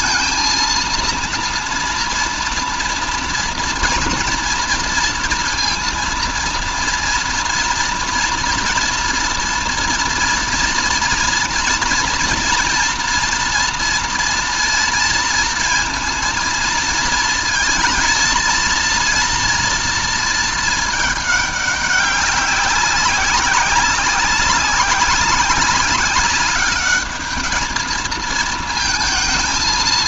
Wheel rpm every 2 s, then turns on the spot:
230, 230, 230, 230, 240, 230, 230, 230, 230, 230, 210, 190, 190, 210, 230.
none